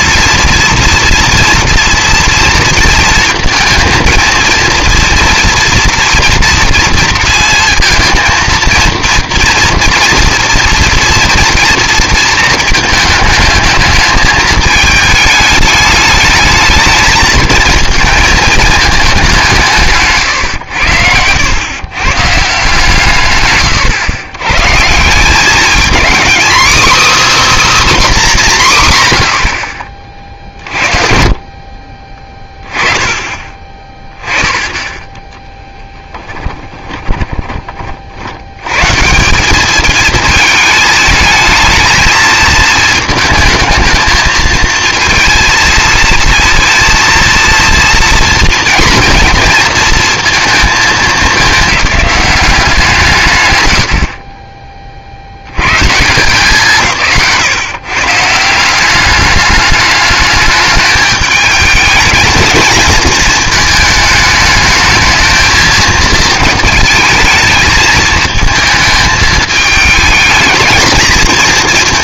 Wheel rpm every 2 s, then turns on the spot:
240, 230, 230, 230, 230, 230, 220, 220, 210, 220, 100, 150, 140, 290, 140, 50, 20, 10, 10, 100, 220, 220, 220, 230, 230, 220, 170, 20, 160, 190, 210, 220, 220, 220, 220, 220.
30-32 36-38